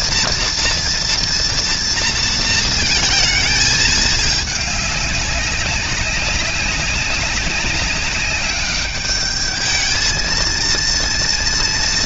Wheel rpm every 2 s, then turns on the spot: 230, 230, 210, 190, 200, 230.
none